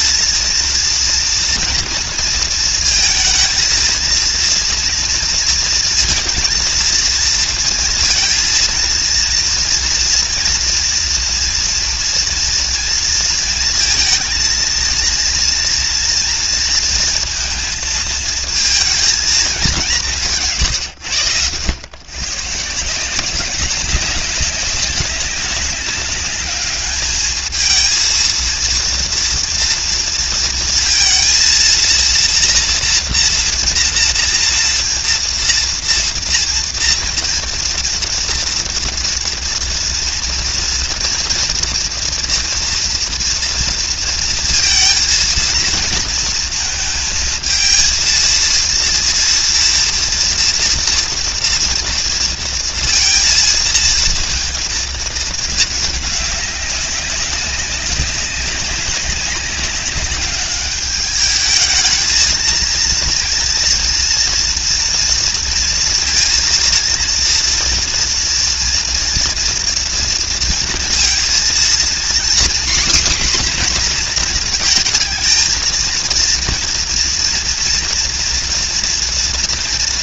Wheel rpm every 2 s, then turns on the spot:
230, 230, 230, 230, 230, 230, 240, 230, 230, 230, 200, 110, 190, 190, 220, 230, 230, 230, 230, 230, 240, 230, 220, 230, 220, 230, 230, 230, 210, 190, 200, 210, 230, 230, 240, 230, 240, 250, 230, 230.
none